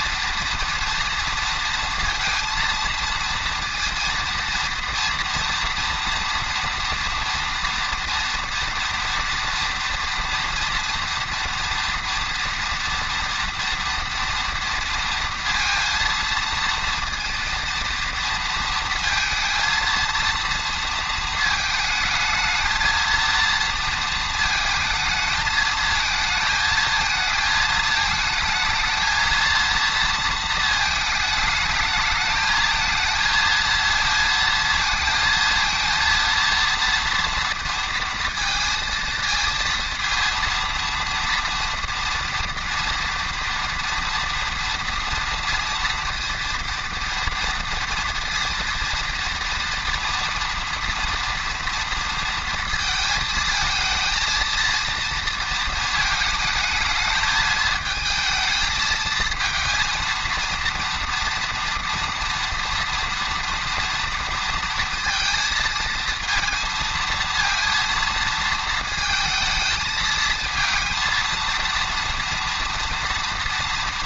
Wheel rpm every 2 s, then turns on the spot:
230, 230, 230, 230, 230, 230, 230, 230, 230, 230, 230, 220, 220, 220, 220, 220, 220, 220, 230, 230, 230, 230, 230, 230, 230, 230, 230, 230, 220, 220, 230, 230, 230, 230, 230, 230, 230.
none